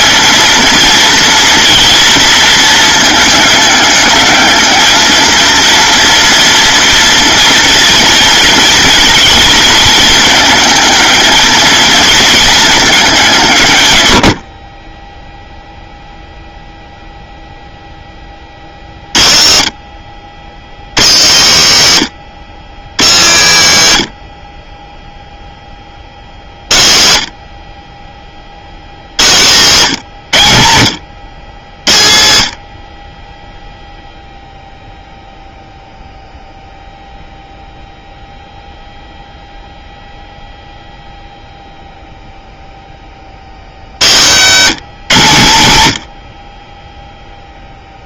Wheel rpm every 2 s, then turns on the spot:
230, 220, 220, 230, 230, 220, 220, 30, 0, 50, 110, 120, 10, 50, 70, 90, 50, 0, 0, 0, 0, 10, 150, 10.
none